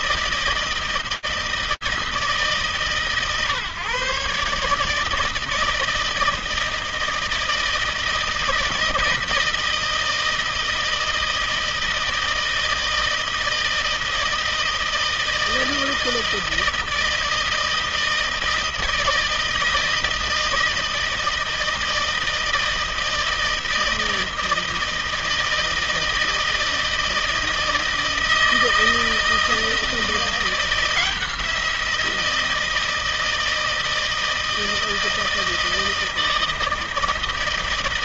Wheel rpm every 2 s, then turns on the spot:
160, 150, 150, 160, 160, 160, 160, 160, 160, 160, 160, 160, 160, 160, 160, 170, 160, 160, 160.
none